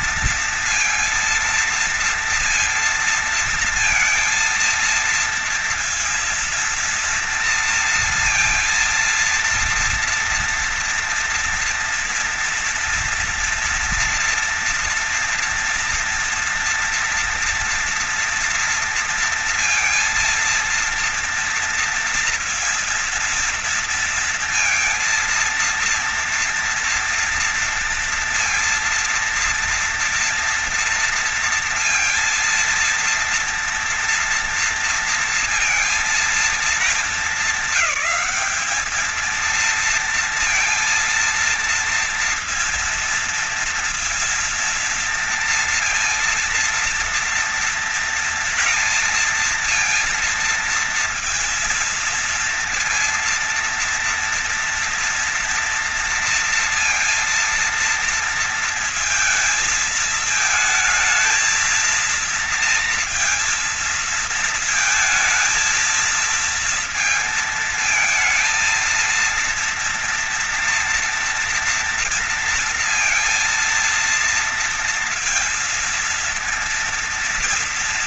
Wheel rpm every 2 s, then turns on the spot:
230, 230, 230, 230, 230, 230, 230, 230, 230, 230, 230, 230, 230, 230, 230, 230, 230, 230, 210, 210, 230, 230, 230, 230, 230, 230, 230, 230, 230, 230, 220, 230, 220, 230, 230, 230, 230, 230, 230.
none